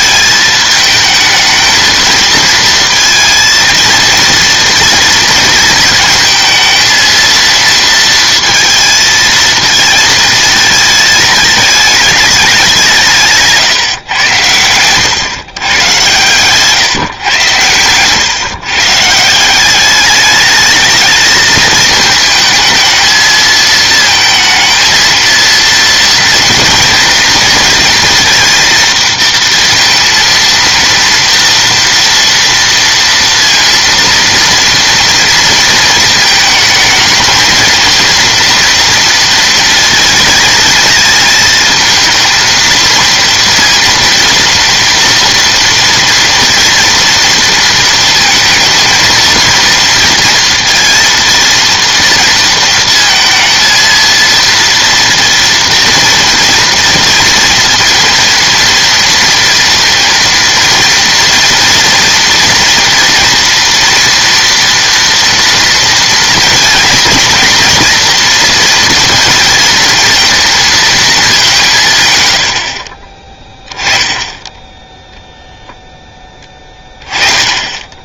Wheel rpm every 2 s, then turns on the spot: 220, 230, 230, 230, 230, 230, 180, 100, 140, 140, 210, 220, 230, 230, 230, 230, 230, 230, 220, 230, 220, 220, 230, 230, 220, 230, 220, 230, 230, 230, 230, 230, 230, 230, 230, 230, 60, 10, 10.
14-16